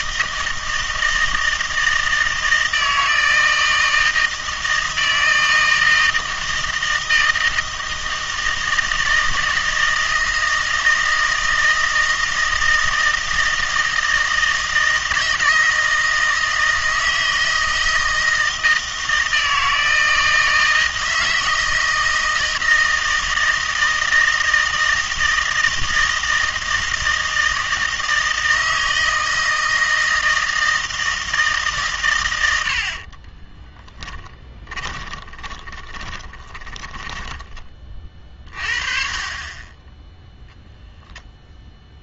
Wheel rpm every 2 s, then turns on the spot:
160, 160, 160, 160, 160, 160, 160, 160, 160, 160, 160, 160, 160, 160, 160, 160, 70, 20, 10, 40, 0.
34-38